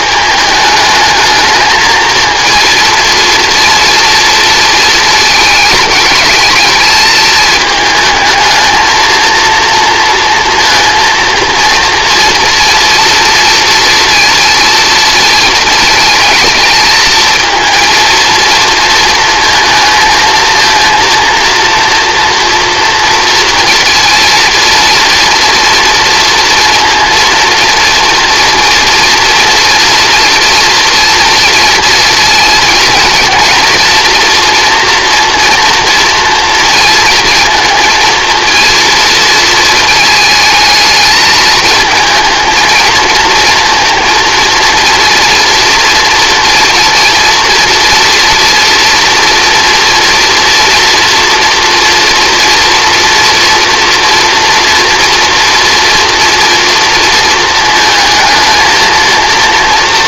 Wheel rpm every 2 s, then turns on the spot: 210, 220, 220, 220, 220, 230, 230, 230, 220, 230, 230, 230, 230, 230, 230, 230, 230, 240, 230, 230, 220, 220, 230, 230, 230, 230, 230, 230, 230, 230.
none